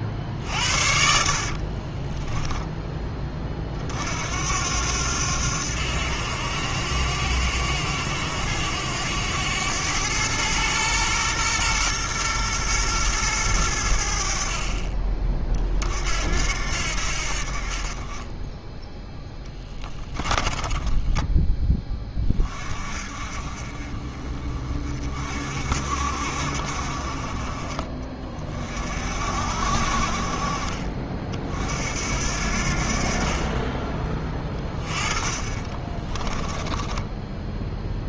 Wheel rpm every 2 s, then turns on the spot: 60, 10, 80, 90, 90, 110, 110, 40, 70, 10, 10, 40, 40, 50, 50, 50, 60, 20, 10.
0-2 20-22 34-38